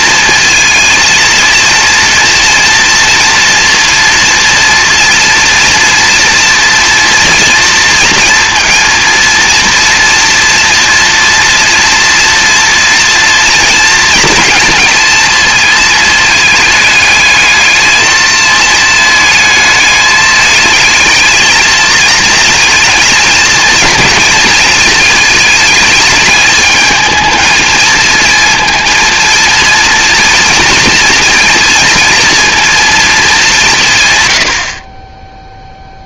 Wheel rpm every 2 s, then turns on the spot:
230, 230, 230, 230, 230, 230, 230, 230, 220, 220, 220, 230, 220, 210, 230, 230, 230, 50.
none